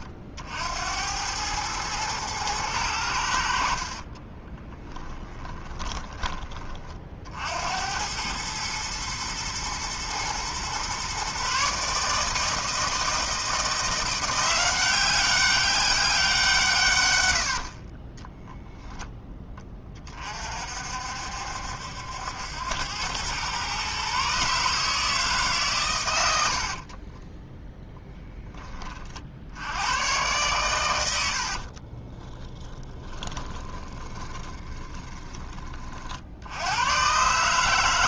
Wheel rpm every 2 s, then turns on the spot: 80, 100, 30, 40, 110, 120, 160, 180, 130, 10, 60, 90, 150, 30, 30, 110, 10, 20, 110.
4-6 26-28 32-36